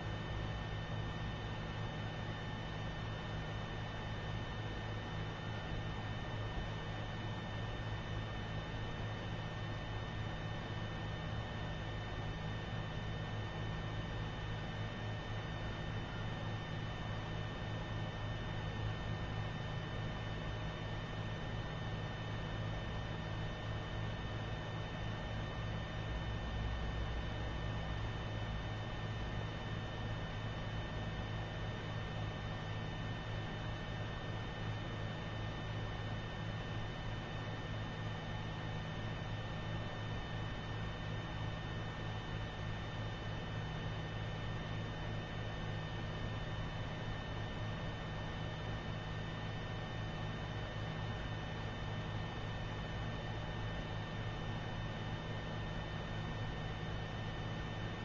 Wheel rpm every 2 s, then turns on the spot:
0, 0, 0, 0, 0, 0, 0, 0, 0, 0, 0, 0, 0, 0, 0, 0, 0, 0, 0, 0, 0, 0, 0, 0, 0, 0, 0, 0, 0.
none